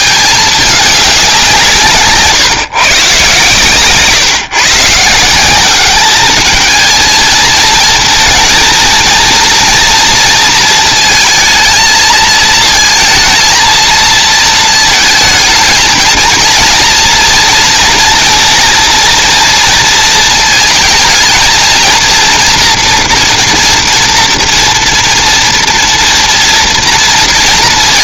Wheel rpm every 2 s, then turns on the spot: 210, 130, 140, 220, 230, 230, 230, 230, 230, 230, 220, 230, 240, 230.
none